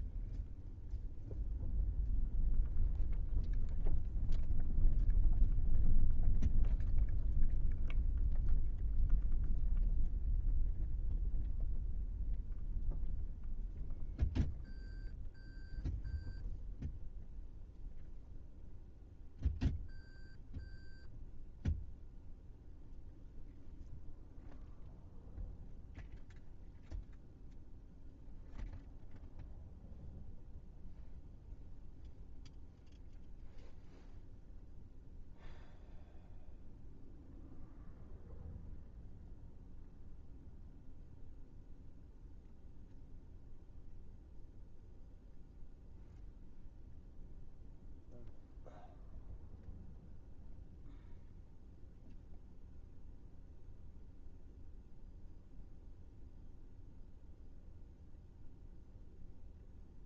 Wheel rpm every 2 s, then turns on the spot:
0, 0, 0, 0, 0, 0, 0, 0, 0, 0, 0, 0, 0, 0, 0, 0, 0, 0, 0, 0, 0, 0, 0, 0, 0, 0, 0, 0, 0, 0.
none